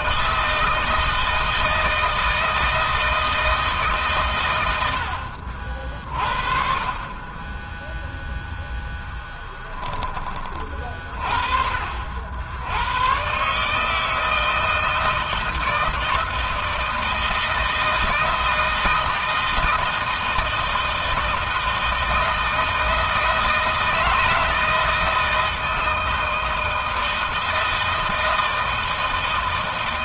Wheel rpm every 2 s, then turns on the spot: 160, 160, 90, 40, 0, 40, 100, 160, 160, 160, 160, 160, 160, 160, 160.
none